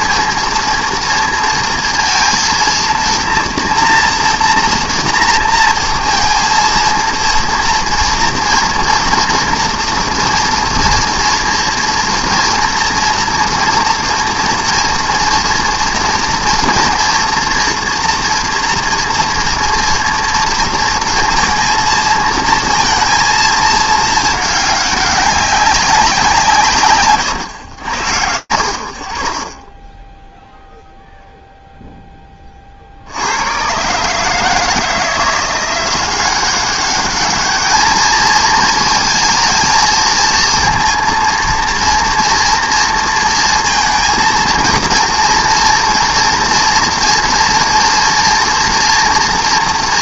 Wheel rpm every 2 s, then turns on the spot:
230, 230, 230, 230, 230, 230, 230, 230, 230, 230, 230, 230, 210, 170, 60, 0, 70, 160, 210, 230, 230, 230, 230, 230, 240.
none